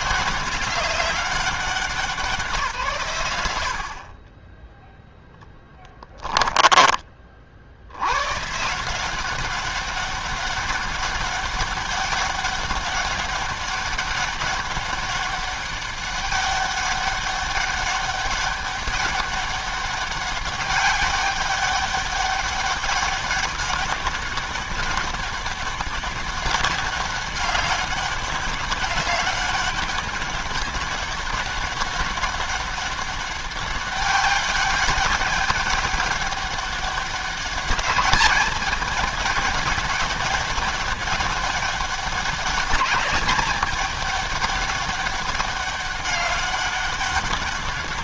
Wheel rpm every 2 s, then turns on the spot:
190, 140, 10, 10, 130, 200, 200, 200, 200, 200, 200, 200, 200, 200, 200, 200, 200, 200, 200, 210, 200, 200, 200, 200.
6-8